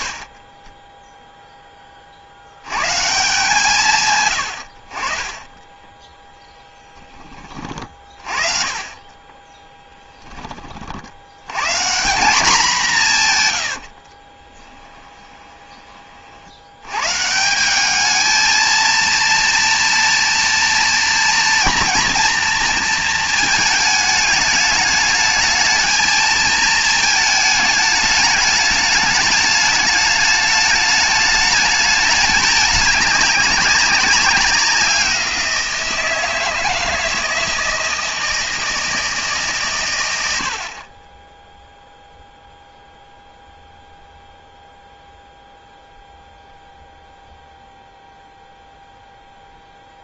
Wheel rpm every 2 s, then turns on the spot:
40, 100, 70, 10, 30, 70, 160, 20, 140, 230, 230, 230, 210, 220, 210, 210, 200, 180, 160, 160, 30, 0, 0, 0, 0.
14-16